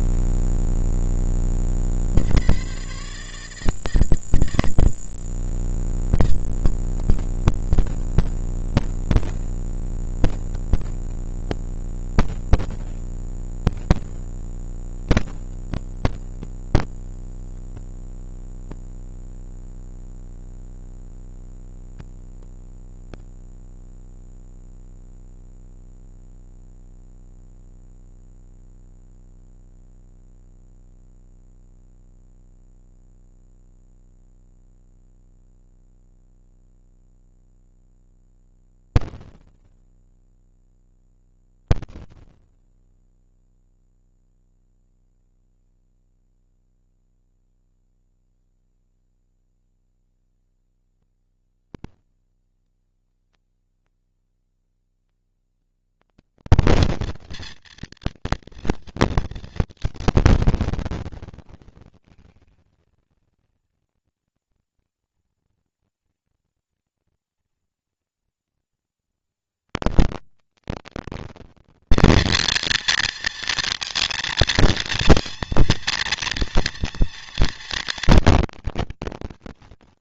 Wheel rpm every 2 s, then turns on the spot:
80, 150, 160, 160, 160, 180, 230, 230, 230, 230, 230, 230, 230, 220, 160, 160, 160, 160, 160, 160, 160, 160, 170, 190, 220, 230, 220, 230, 230, 220, 210, 230, 230, 230, 230, 230, 230, 230, 230, 230.
none